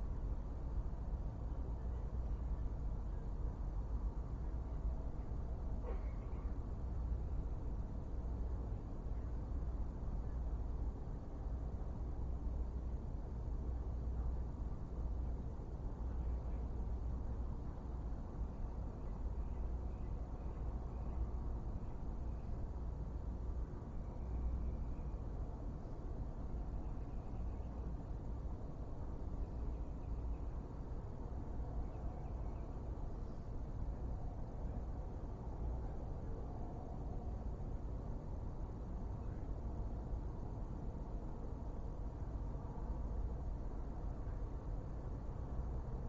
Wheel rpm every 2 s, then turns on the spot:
0, 0, 0, 0, 0, 0, 0, 0, 0, 0, 0, 0, 0, 0, 0, 0, 0, 0, 0, 0, 0, 0, 0.
none